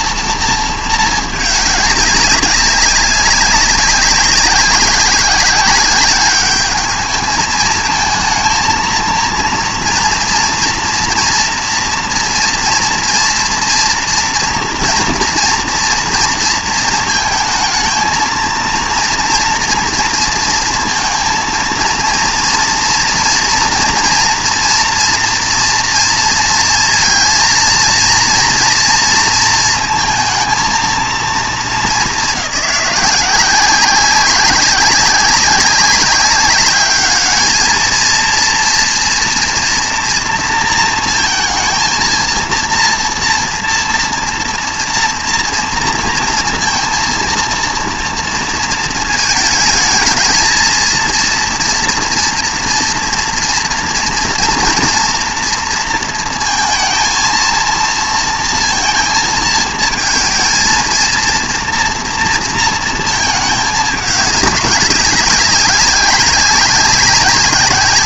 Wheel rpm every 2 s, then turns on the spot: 220, 200, 190, 210, 230, 230, 230, 230, 230, 230, 230, 240, 230, 230, 230, 230, 190, 190, 210, 230, 230, 230, 230, 230, 220, 230, 230, 230, 230, 230, 230, 230, 200, 190.
none